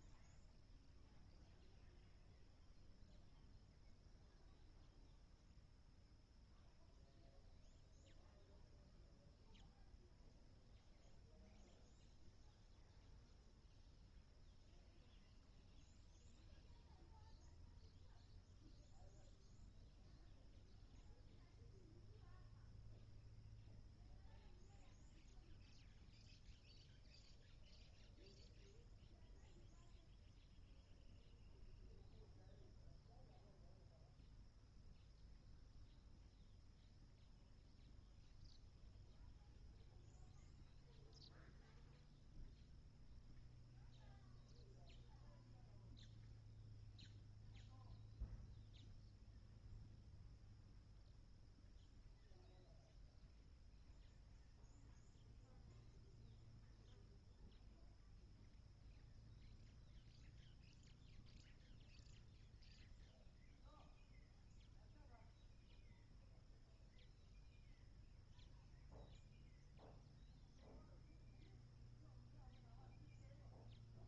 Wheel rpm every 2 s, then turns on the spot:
0, 0, 0, 0, 0, 0, 0, 0, 0, 0, 0, 0, 0, 0, 0, 0, 0, 0, 0, 0, 0, 0, 0, 0, 0, 0, 0, 0, 0, 0, 0, 0, 0, 0, 0, 0, 0.
none